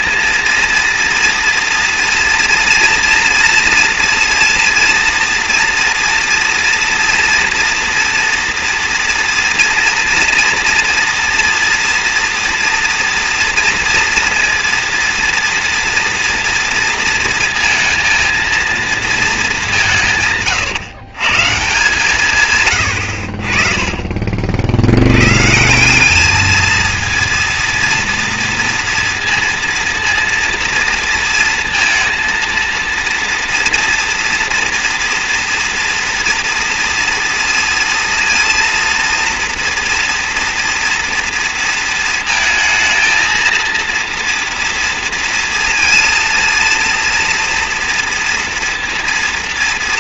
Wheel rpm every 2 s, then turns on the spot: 230, 240, 230, 230, 230, 230, 230, 230, 230, 230, 120, 100, 100, 230, 230, 230, 230, 240, 230, 240, 240, 220, 230, 230, 230.
none